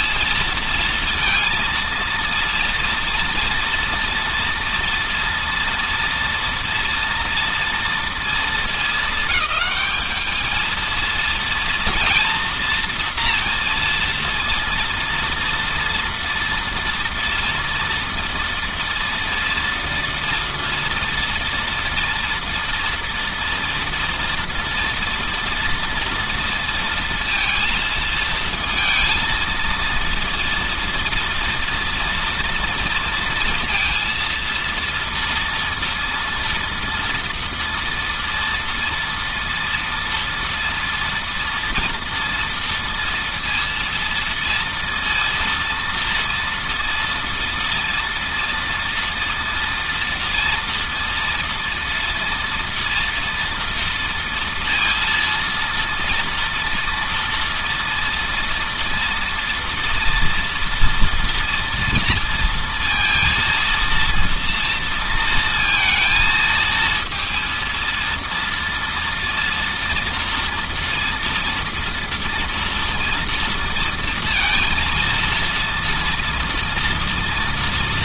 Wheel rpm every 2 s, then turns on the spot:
230, 230, 240, 230, 230, 220, 240, 230, 230, 230, 230, 230, 230, 230, 230, 230, 240, 230, 230, 230, 240, 230, 230, 230, 230, 230, 230, 230, 230, 240, 230, 230, 230, 220, 230, 240, 230, 230, 230.
none